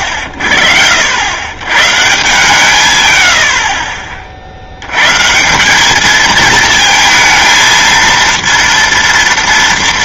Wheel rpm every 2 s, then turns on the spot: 50, 140, 70, 220, 230.
none